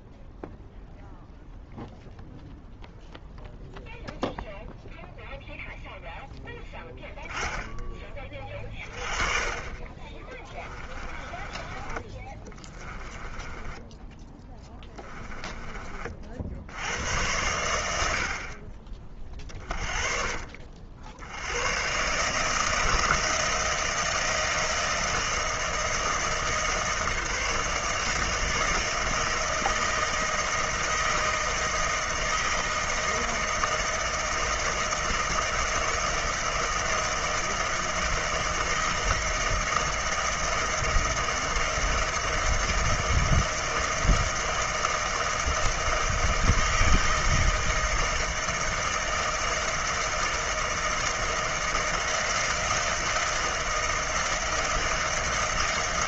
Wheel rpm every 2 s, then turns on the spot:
0, 0, 0, 10, 20, 20, 20, 10, 80, 40, 50, 160, 160, 160, 160, 160, 160, 160, 160, 160, 160, 160, 160, 160, 160, 160, 160, 160.
10-16